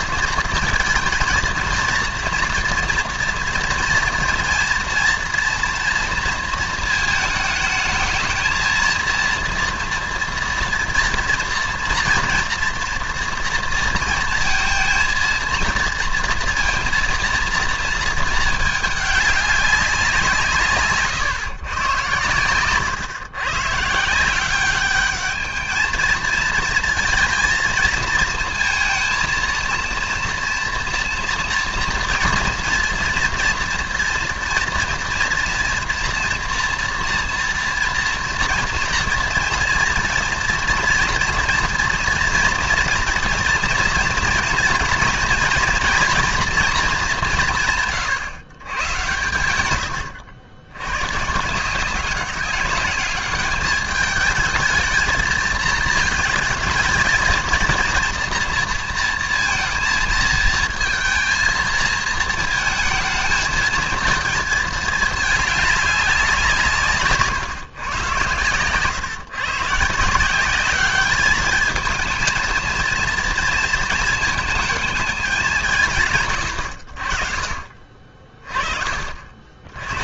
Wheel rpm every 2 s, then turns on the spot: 220, 230, 230, 220, 230, 230, 230, 230, 230, 210, 150, 120, 190, 230, 230, 230, 240, 230, 240, 230, 230, 230, 230, 220, 130, 100, 200, 220, 220, 230, 230, 220, 220, 160, 120, 200, 230, 220, 90, 30.
none